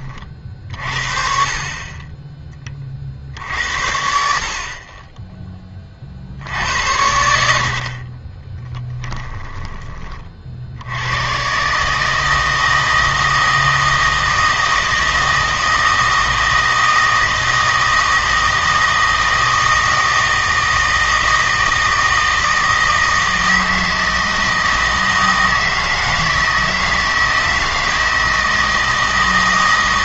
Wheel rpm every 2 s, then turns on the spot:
50, 30, 40, 80, 10, 70, 160, 160, 160, 160, 160, 160, 160, 160, 160.
8-10